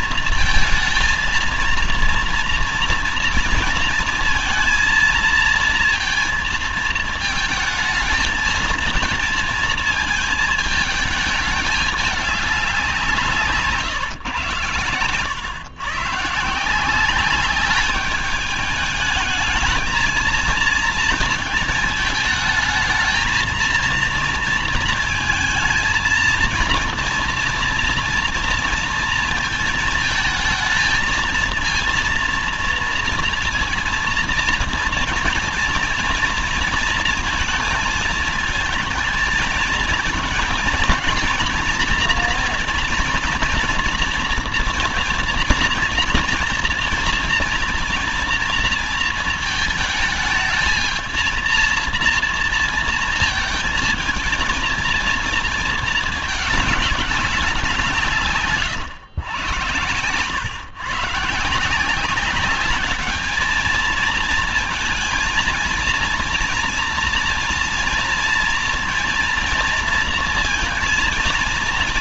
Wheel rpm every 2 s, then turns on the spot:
230, 230, 220, 220, 220, 220, 190, 120, 170, 210, 230, 220, 230, 240, 230, 230, 230, 230, 230, 220, 230, 240, 240, 240, 230, 220, 230, 230, 200, 120, 130, 200, 230, 230, 230, 230.
none